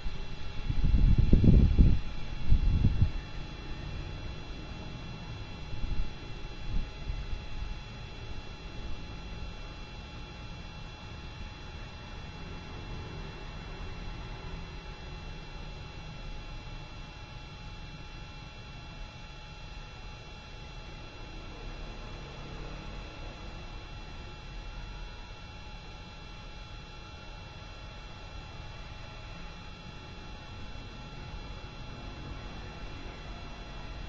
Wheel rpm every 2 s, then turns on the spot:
0, 0, 0, 0, 0, 0, 0, 0, 0, 0, 0, 0, 0, 0, 0, 0, 0.
none